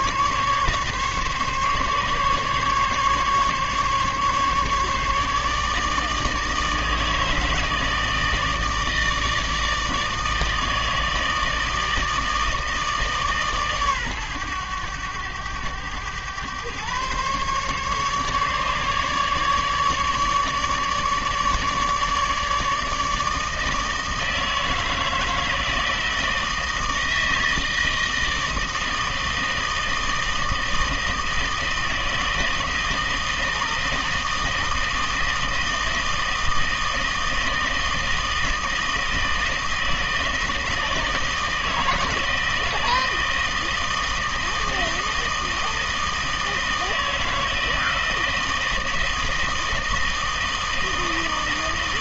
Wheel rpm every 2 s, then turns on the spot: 140, 140, 150, 160, 160, 160, 150, 100, 130, 150, 150, 160, 160, 160, 160, 160, 160, 160, 160, 160, 160, 160, 160, 160, 160, 160.
none